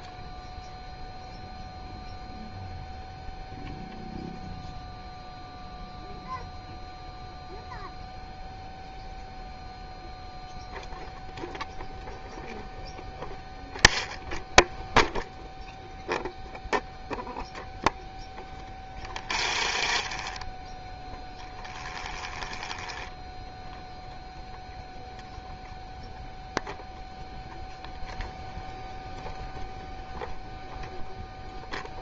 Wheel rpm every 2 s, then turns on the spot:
0, 0, 0, 0, 0, 0, 0, 0, 0, 20, 10, 10, 0, 0, 0, 0.
18-24